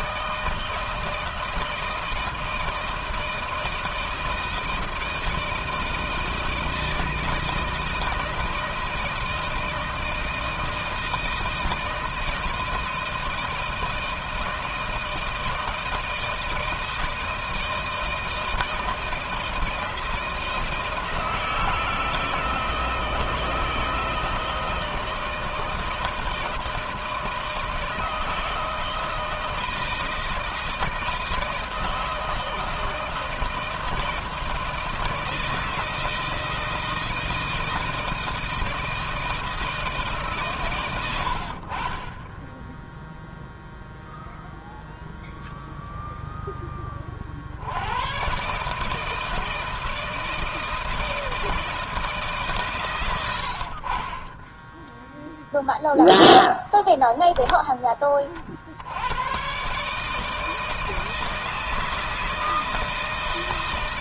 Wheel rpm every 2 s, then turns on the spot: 160, 160, 160, 160, 160, 160, 160, 160, 160, 160, 170, 160, 160, 160, 160, 160, 160, 160, 160, 160, 80, 0, 0, 60, 160, 160, 100, 0, 10, 110, 160, 160.
none